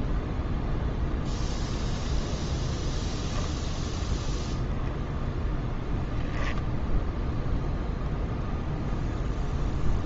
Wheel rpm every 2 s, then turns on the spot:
0, 0, 0, 0, 0.
none